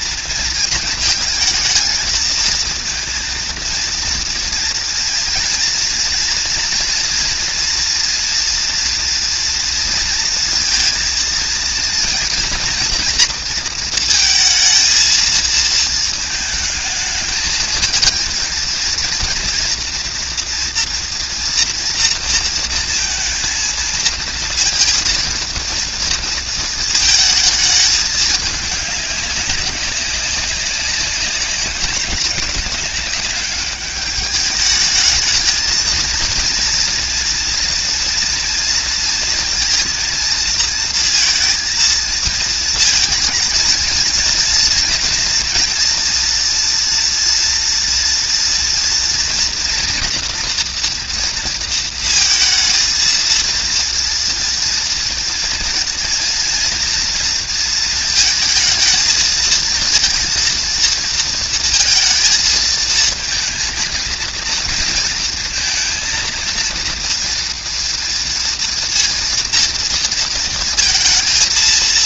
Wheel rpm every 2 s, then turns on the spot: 220, 230, 230, 230, 230, 230, 230, 220, 220, 220, 230, 230, 230, 230, 210, 190, 200, 200, 230, 230, 230, 230, 230, 230, 230, 240, 230, 230, 230, 220, 230, 230, 230, 230, 230, 230.
none